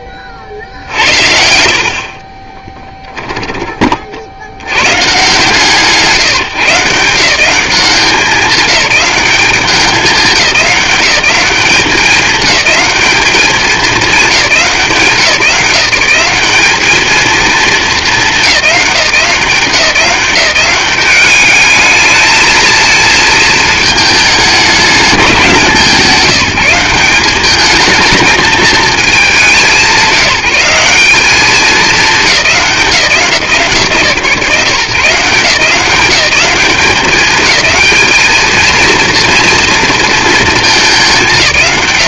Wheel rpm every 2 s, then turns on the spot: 40, 20, 90, 150, 190, 200, 200, 170, 210, 200, 180, 220, 210, 190, 220, 190, 180, 140, 200, 220, 220.
2-4